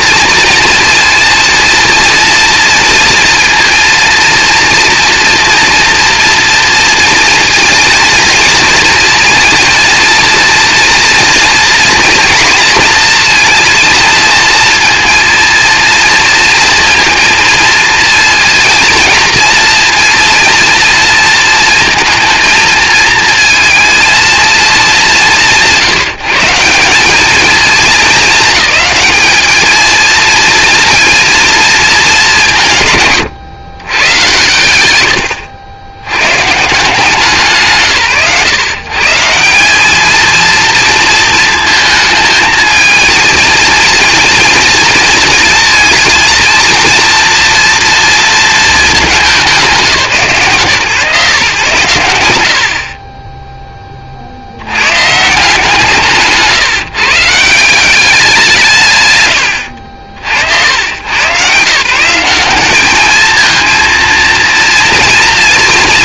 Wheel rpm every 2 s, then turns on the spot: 230, 230, 230, 230, 230, 230, 230, 230, 230, 230, 230, 220, 210, 180, 220, 230, 150, 130, 140, 140, 230, 230, 240, 230, 220, 150, 50, 90, 160, 150, 90, 200, 220.
none